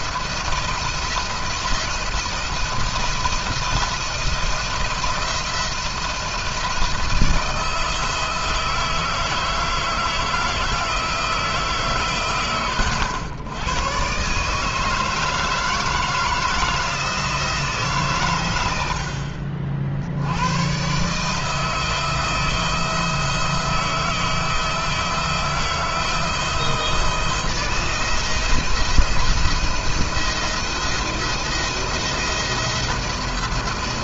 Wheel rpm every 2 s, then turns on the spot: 170, 170, 170, 170, 160, 160, 120, 150, 160, 90, 110, 160, 160, 160, 170, 170, 170.
none